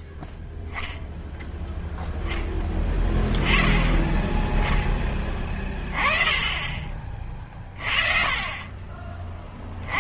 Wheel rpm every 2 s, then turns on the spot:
0, 10, 20, 30, 30.
none